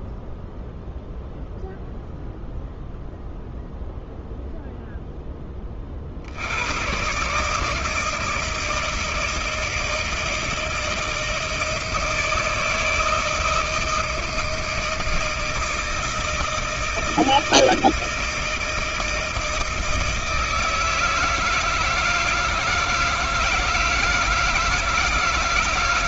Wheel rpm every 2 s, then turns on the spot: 0, 0, 0, 120, 160, 160, 160, 160, 160, 160, 160, 160, 160.
none